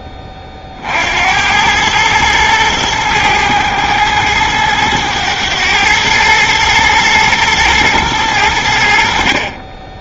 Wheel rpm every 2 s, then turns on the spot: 50, 110, 110, 110, 80.
none